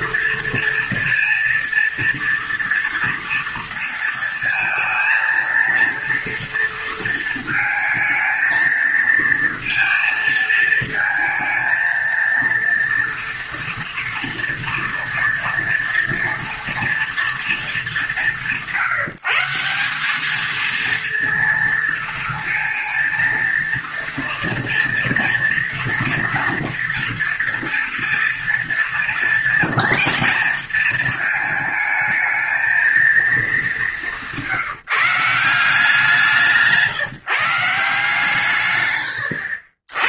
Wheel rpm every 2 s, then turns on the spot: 230, 230, 230, 230, 230, 230, 240, 230, 230, 170, 230, 230, 230, 230, 230, 230, 220, 170, 160, 120.
38-40